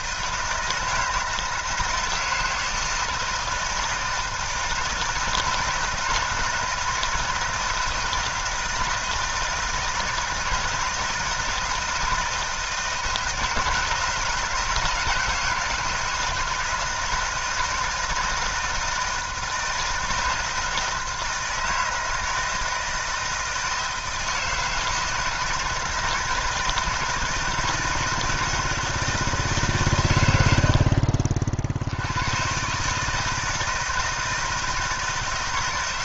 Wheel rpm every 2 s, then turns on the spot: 160, 160, 160, 160, 170, 160, 160, 160, 160, 160, 160, 160, 160, 160, 160, 60, 150, 160.
none